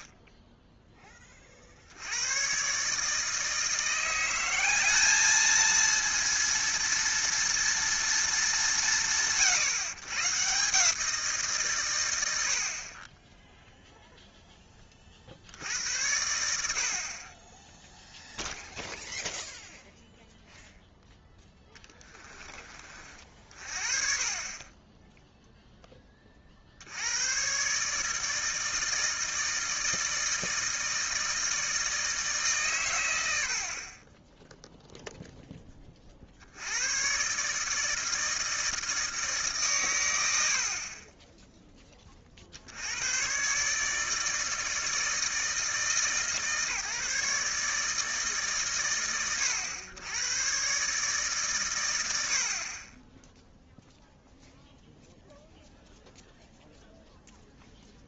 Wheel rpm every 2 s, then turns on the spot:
0, 140, 200, 230, 170, 150, 20, 20, 60, 0, 0, 30, 20, 80, 160, 160, 120, 0, 100, 160, 30, 70, 160, 150, 120, 130, 30, 0, 0.
none